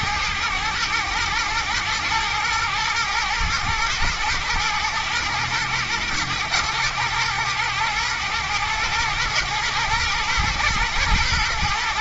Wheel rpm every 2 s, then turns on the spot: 110, 110, 110, 110, 110, 120.
none